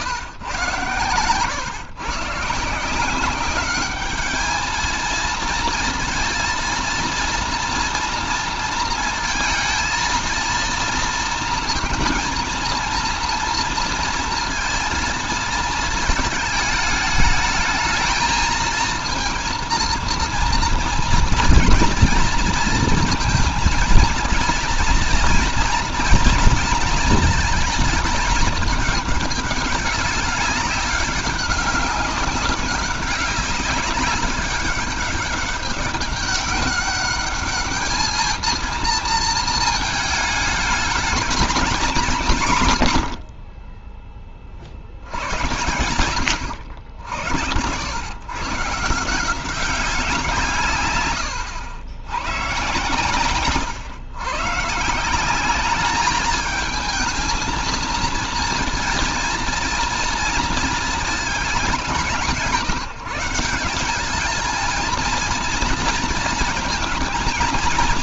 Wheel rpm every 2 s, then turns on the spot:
110, 140, 210, 230, 230, 230, 230, 230, 210, 220, 230, 230, 230, 230, 210, 200, 190, 200, 200, 220, 220, 170, 30, 80, 120, 150, 120, 130, 210, 230, 230, 170, 220, 220.
none